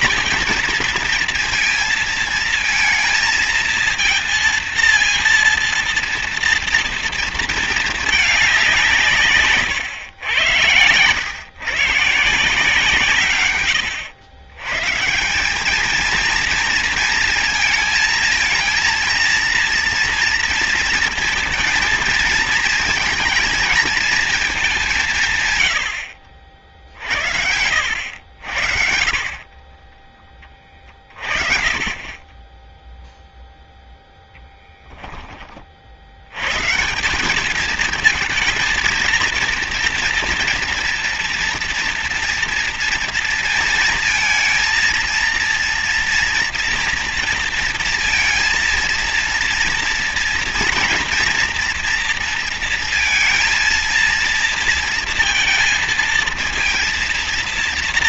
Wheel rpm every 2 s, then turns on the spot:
230, 230, 230, 230, 190, 100, 150, 130, 230, 230, 230, 230, 200, 60, 70, 30, 10, 0, 160, 230, 230, 230, 230, 230, 230, 230, 230, 230, 230.
none